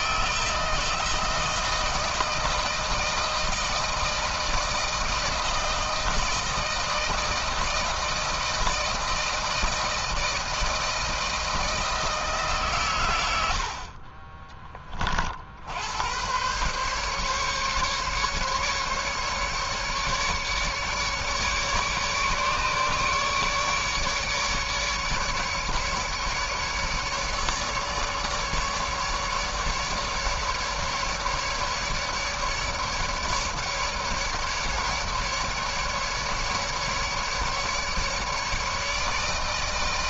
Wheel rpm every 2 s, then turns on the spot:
160, 160, 160, 160, 160, 160, 110, 20, 120, 140, 150, 150, 150, 150, 150, 150, 150, 150, 150, 150.
none